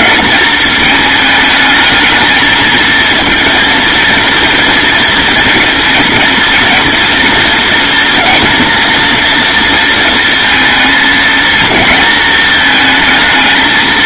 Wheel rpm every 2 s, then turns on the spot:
220, 220, 230, 230, 230, 220, 220.
none